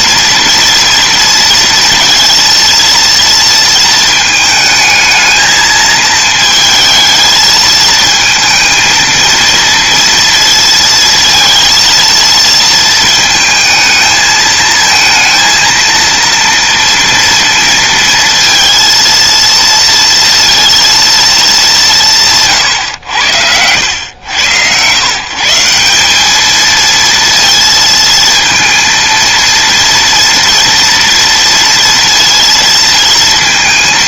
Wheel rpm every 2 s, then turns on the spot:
230, 230, 220, 220, 220, 230, 220, 230, 230, 230, 230, 100, 140, 230, 230, 230, 230.
none